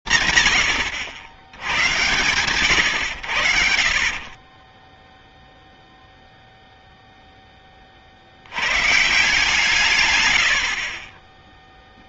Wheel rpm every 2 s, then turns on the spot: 90, 0, 0, 120, 60, 10.
none